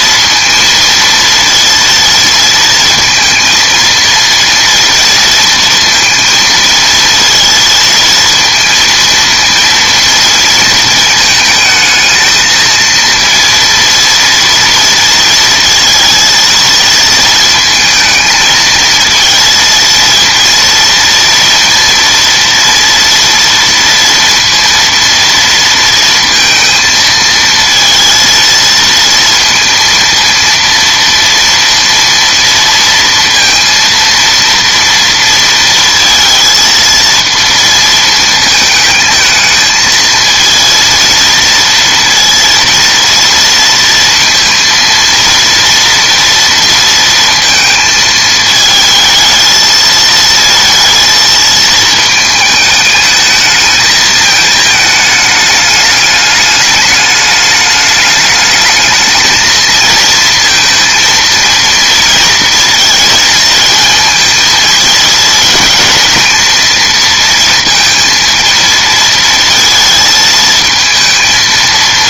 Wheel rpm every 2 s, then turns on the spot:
230, 230, 230, 230, 230, 220, 230, 230, 220, 230, 230, 230, 230, 230, 230, 230, 230, 230, 230, 220, 230, 230, 230, 230, 220, 230, 210, 220, 210, 220, 230, 230, 220, 230, 230, 220.
none